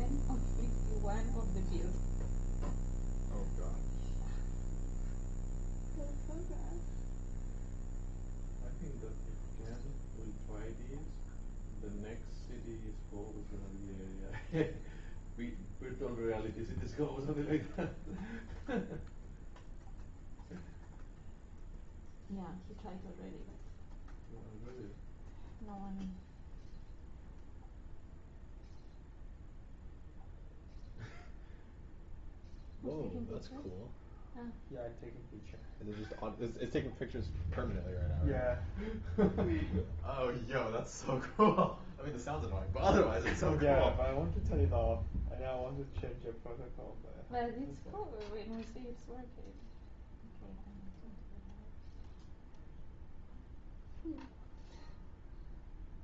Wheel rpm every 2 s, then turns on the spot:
0, 0, 0, 0, 0, 0, 0, 0, 0, 0, 0, 0, 0, 0, 0, 0, 0, 0, 0, 0, 0, 0, 0, 0, 0, 0, 0, 0.
none